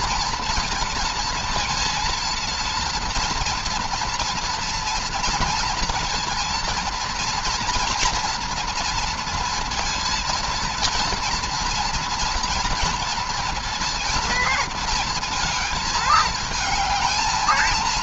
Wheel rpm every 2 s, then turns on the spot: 230, 230, 240, 230, 230, 230, 230, 230, 220.
none